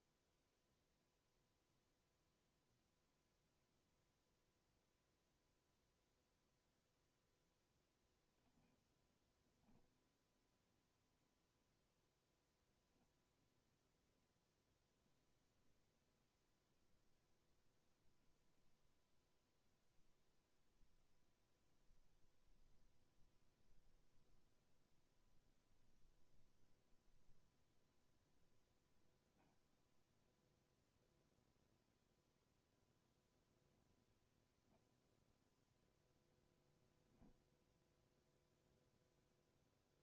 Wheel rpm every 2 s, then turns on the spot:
0, 0, 0, 0, 0, 0, 0, 0, 0, 0, 0, 0, 0, 0, 0, 0, 0, 0, 0, 0.
none